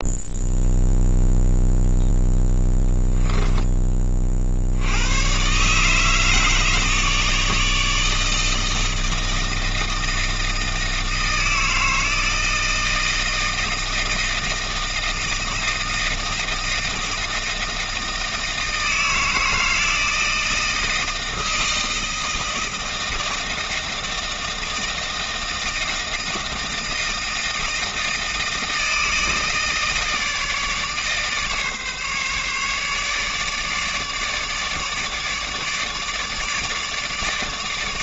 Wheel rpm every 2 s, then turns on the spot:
0, 0, 80, 150, 160, 160, 160, 160, 160, 160, 160, 160, 160, 160, 160, 150, 150, 150, 150.
none